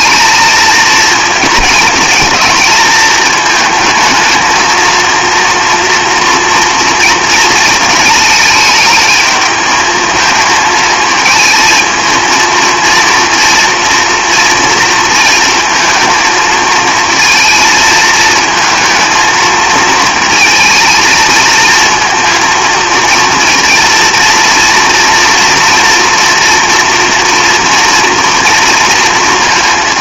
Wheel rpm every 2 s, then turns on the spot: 230, 220, 230, 230, 220, 220, 230, 230, 220, 220, 220, 230, 230, 230, 230.
none